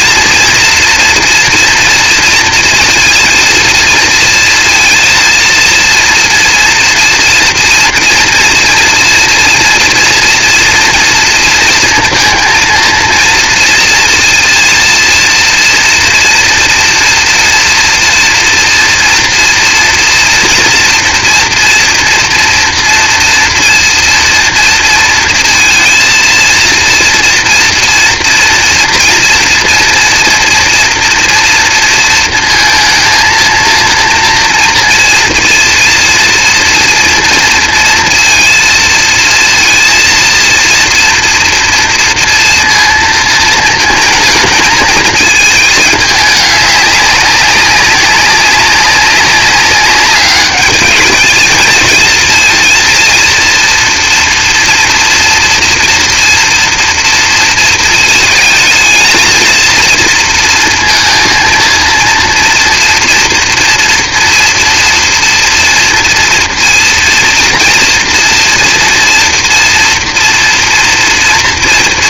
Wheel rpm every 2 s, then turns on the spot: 230, 230, 230, 230, 230, 230, 230, 230, 230, 230, 230, 240, 230, 230, 230, 240, 220, 230, 230, 230, 230, 230, 220, 200, 190, 210, 230, 230, 230, 220, 230, 230, 230, 230, 230, 230.
none